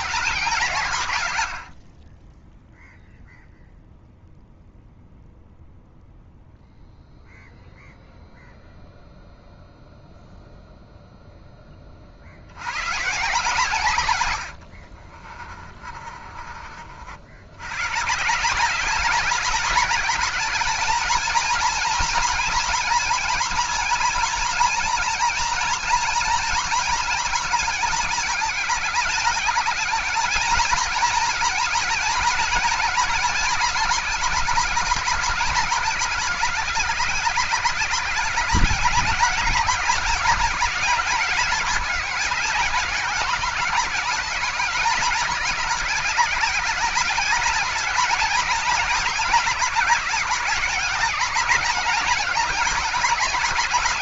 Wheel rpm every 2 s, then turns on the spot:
120, 0, 0, 0, 0, 0, 150, 50, 70, 200, 220, 230, 230, 220, 190, 230, 220, 200, 170, 200, 200, 200, 200, 200, 200, 200, 210.
14-16